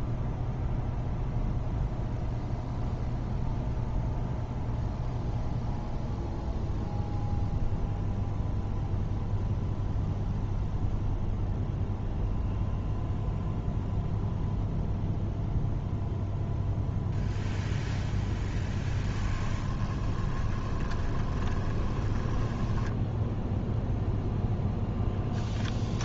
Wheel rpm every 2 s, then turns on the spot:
0, 0, 0, 0, 0, 0, 0, 0, 0, 10, 20, 10, 10.
18-24